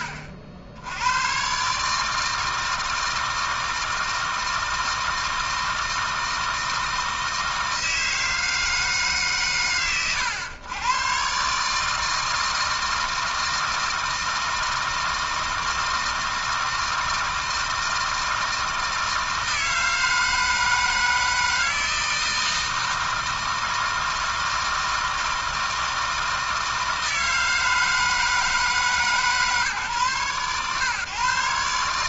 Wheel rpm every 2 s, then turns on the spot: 80, 160, 160, 160, 150, 130, 160, 160, 160, 160, 160, 160, 160, 160, 150, 130.
none